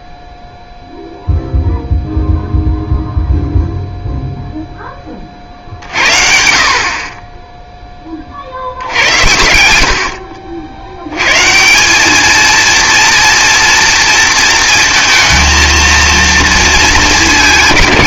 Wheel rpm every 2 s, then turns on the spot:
0, 0, 10, 50, 70, 60, 230, 230, 230.
none